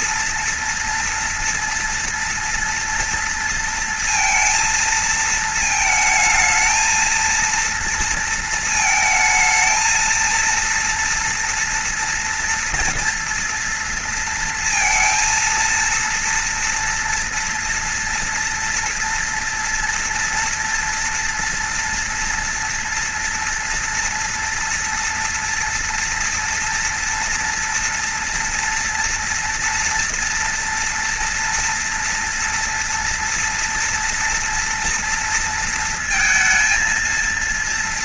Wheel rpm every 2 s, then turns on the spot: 230, 230, 230, 220, 220, 240, 230, 230, 230, 230, 230, 240, 230, 240, 230, 230, 230, 230, 210.
none